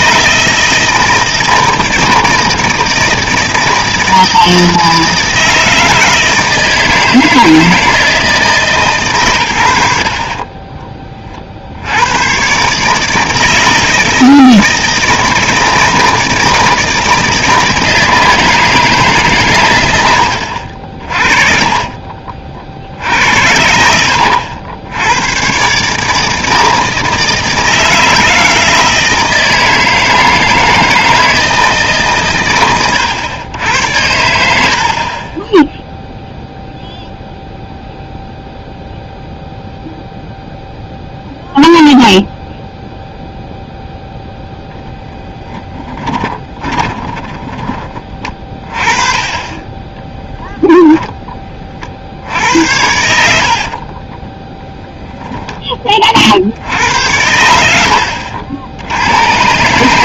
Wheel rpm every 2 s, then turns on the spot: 160, 160, 160, 160, 150, 20, 130, 160, 160, 160, 70, 60, 80, 160, 160, 160, 120, 70, 0, 0, 0, 0, 0, 20, 30, 0, 70, 10, 70, 70.
10-12 46-48 52-54